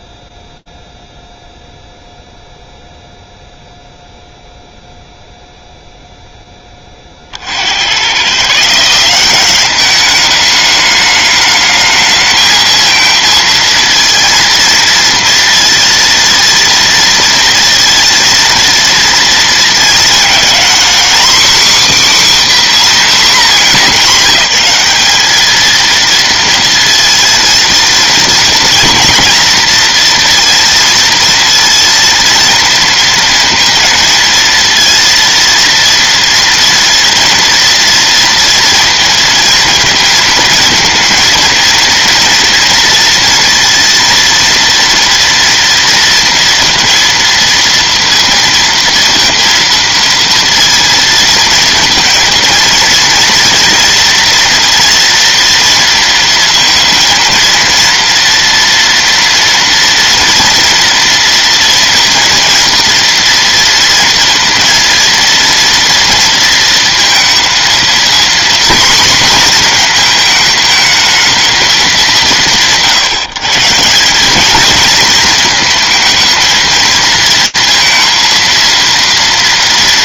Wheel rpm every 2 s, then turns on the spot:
0, 0, 0, 0, 70, 200, 220, 230, 230, 230, 220, 270, 230, 220, 230, 230, 230, 230, 230, 230, 230, 230, 230, 230, 230, 230, 230, 230, 230, 230, 230, 230, 230, 230, 240, 240, 200, 170, 220, 230.
none